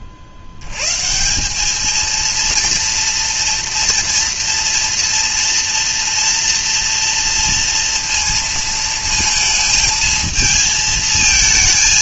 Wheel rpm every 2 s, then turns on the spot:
80, 230, 230, 230, 230, 220.
none